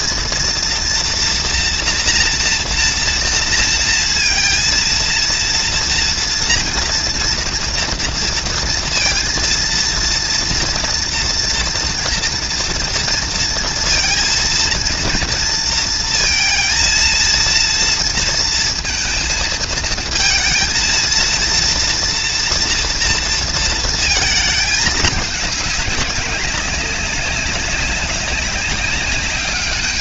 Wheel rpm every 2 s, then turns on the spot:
230, 230, 230, 230, 230, 230, 230, 230, 230, 220, 230, 230, 220, 190, 200.
none